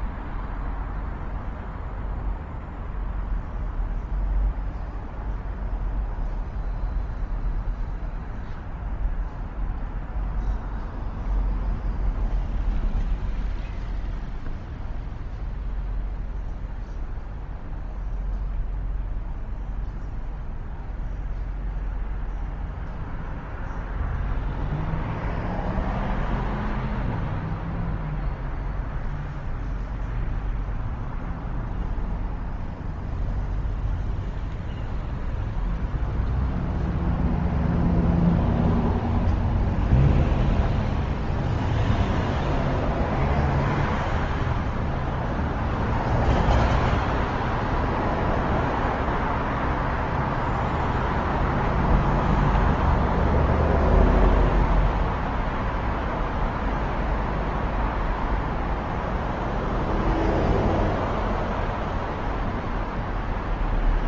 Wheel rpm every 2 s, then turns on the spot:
0, 0, 0, 0, 0, 0, 0, 0, 0, 0, 0, 0, 0, 0, 0, 0, 0, 0, 0, 0, 0, 0, 0, 0, 0, 0, 0, 0, 0, 0, 0, 0.
none